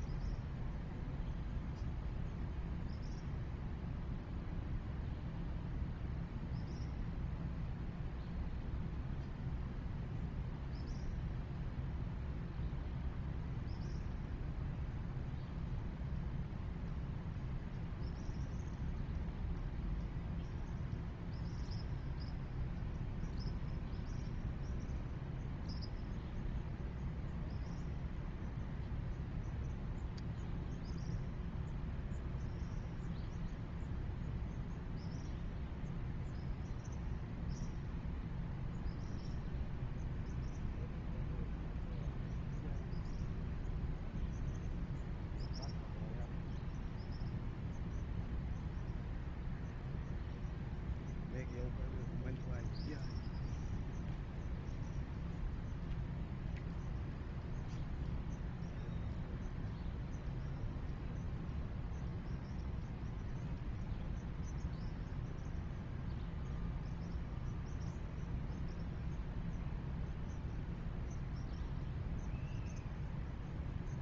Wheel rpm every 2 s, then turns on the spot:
0, 0, 0, 0, 0, 0, 0, 0, 0, 0, 0, 0, 0, 0, 0, 0, 0, 0, 0, 0, 0, 0, 0, 0, 0, 0, 0, 0, 0, 0, 0, 0, 0, 0, 0, 0, 0.
none